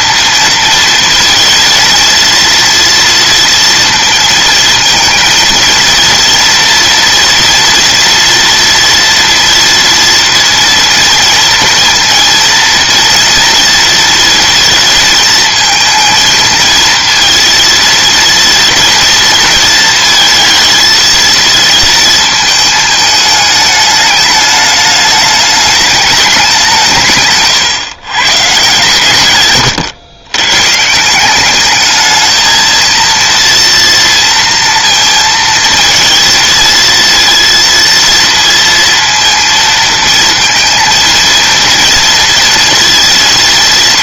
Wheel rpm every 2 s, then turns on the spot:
230, 230, 220, 230, 230, 230, 230, 220, 230, 230, 220, 220, 210, 150, 130, 160, 230, 230, 230, 230, 230, 230.
none